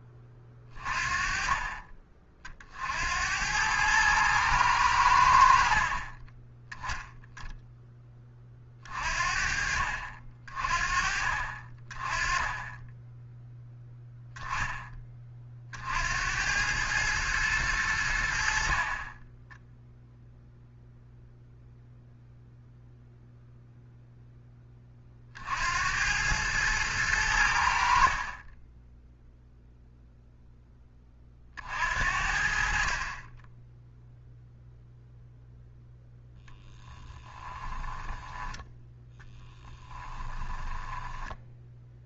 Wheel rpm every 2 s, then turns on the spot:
40, 50, 100, 10, 40, 40, 10, 20, 100, 40, 0, 0, 20, 110, 10, 10, 50, 0, 10, 10, 10.
18-20 28-30 36-42